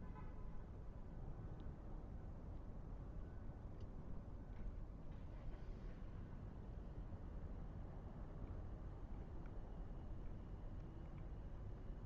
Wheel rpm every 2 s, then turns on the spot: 0, 0, 0, 0, 0, 0.
none